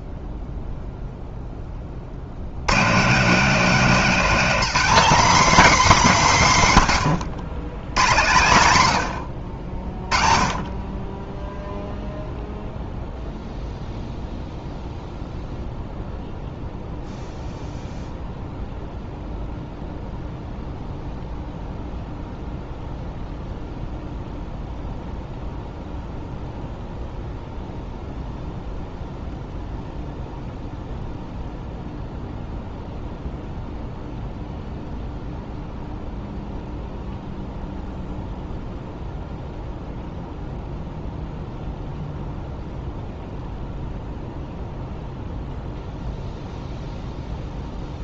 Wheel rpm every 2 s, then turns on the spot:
0, 120, 240, 150, 110, 30, 0, 0, 0, 0, 0, 0, 0, 0, 0, 0, 0, 0, 0, 0, 0, 0, 0, 0.
none